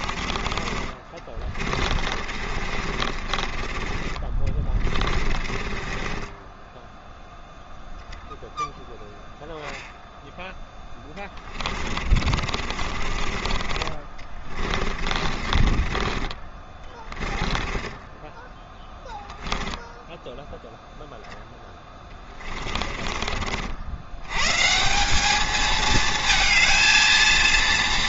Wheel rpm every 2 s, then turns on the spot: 30, 40, 30, 10, 0, 10, 40, 40, 20, 10, 0, 30, 140, 230.
2-8 12-18 22-24